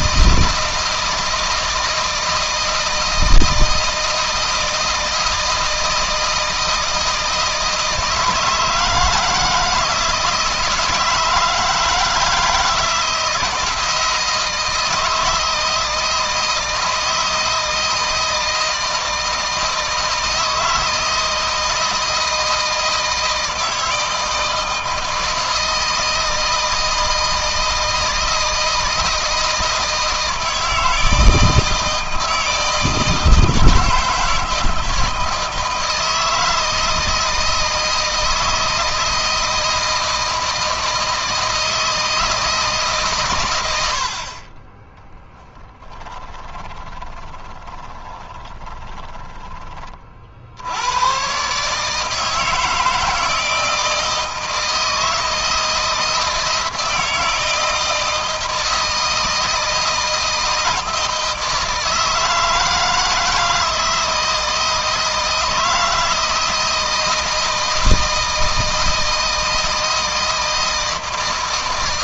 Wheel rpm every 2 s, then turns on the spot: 160, 160, 160, 160, 160, 160, 160, 160, 160, 160, 160, 160, 160, 160, 160, 160, 160, 160, 160, 160, 160, 150, 20, 20, 20, 100, 160, 160, 160, 160, 160, 160, 160, 160, 160, 160.
46-50